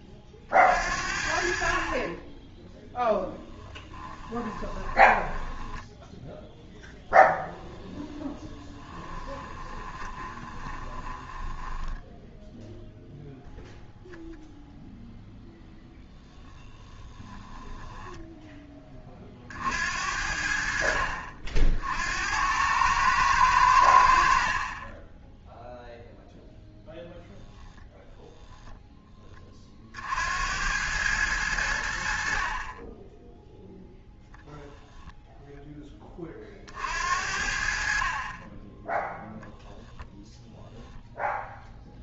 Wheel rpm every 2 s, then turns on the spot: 50, 10, 10, 0, 20, 20, 0, 0, 20, 20, 70, 100, 40, 10, 10, 90, 30, 10, 50, 10, 10.
4-6 8-12 16-18